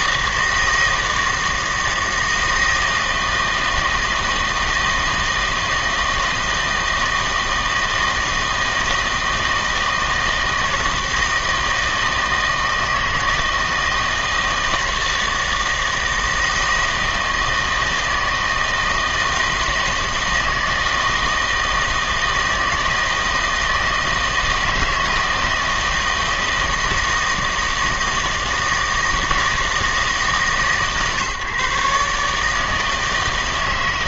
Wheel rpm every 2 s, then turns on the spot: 160, 160, 160, 160, 160, 160, 160, 160, 160, 160, 160, 160, 160, 160, 160, 140, 160.
none